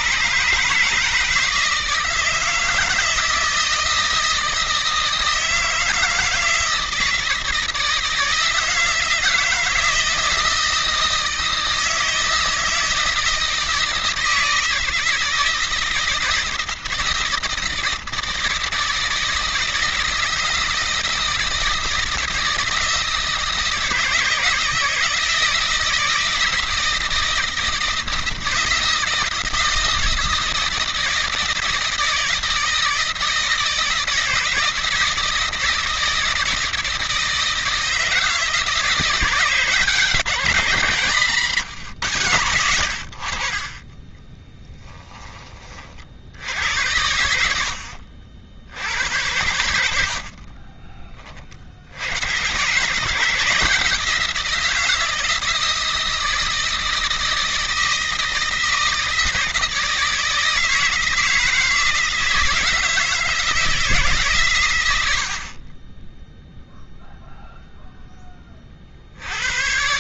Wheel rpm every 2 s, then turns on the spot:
150, 160, 160, 160, 160, 160, 160, 160, 160, 160, 160, 160, 160, 160, 160, 160, 160, 160, 160, 170, 170, 100, 10, 80, 80, 50, 140, 170, 170, 160, 160, 160, 110, 0, 40.
50-52